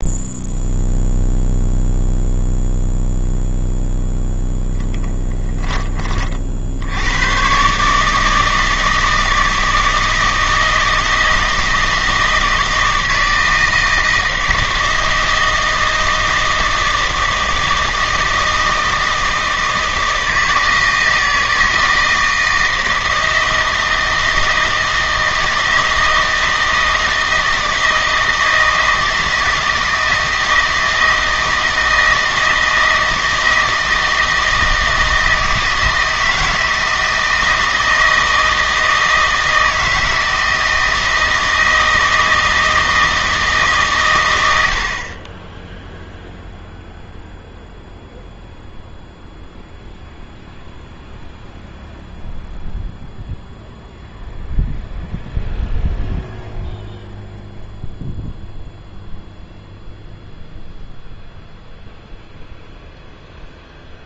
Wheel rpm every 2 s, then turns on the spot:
0, 0, 10, 70, 160, 160, 160, 160, 160, 160, 160, 160, 160, 160, 160, 160, 160, 160, 160, 160, 160, 160, 70, 0, 0, 0, 0, 0, 0, 0, 0, 0.
4-6